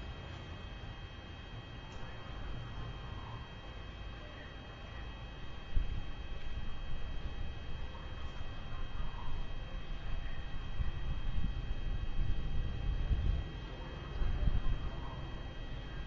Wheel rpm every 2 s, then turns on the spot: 0, 0, 0, 0, 0, 0, 0, 0.
none